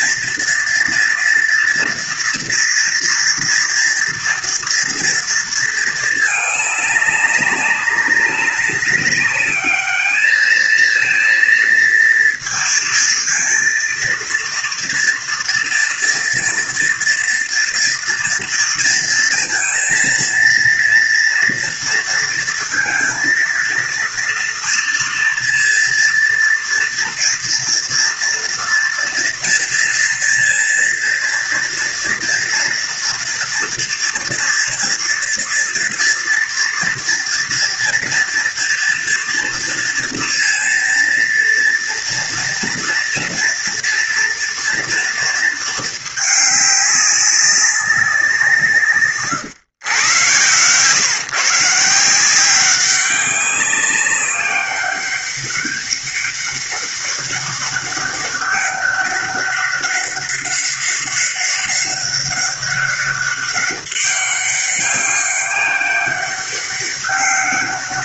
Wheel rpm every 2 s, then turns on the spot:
230, 230, 230, 200, 200, 230, 230, 230, 230, 230, 230, 230, 230, 230, 230, 230, 230, 230, 230, 230, 230, 230, 230, 200, 130, 140, 190, 200, 200, 200, 200, 200, 190, 200.
48-50